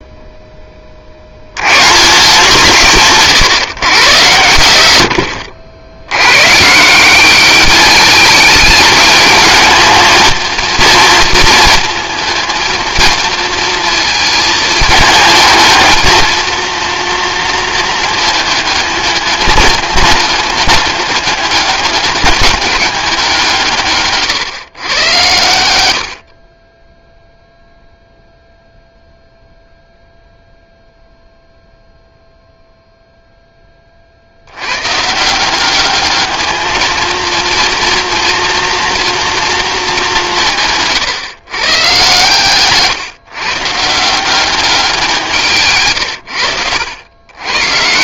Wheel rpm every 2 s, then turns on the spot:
40, 170, 100, 170, 210, 230, 230, 220, 230, 210, 210, 200, 120, 10, 0, 0, 0, 130, 220, 230, 150, 140, 180, 100.
none